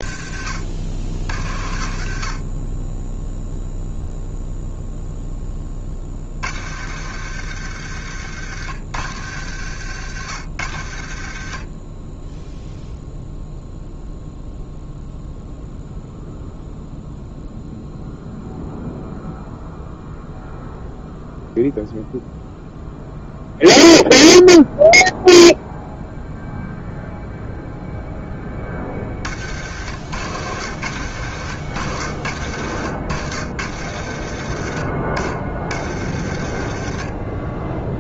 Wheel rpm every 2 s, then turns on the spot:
60, 10, 10, 100, 90, 60, 0, 0, 0, 0, 0, 0, 0, 0, 50, 90, 80, 60, 40.
none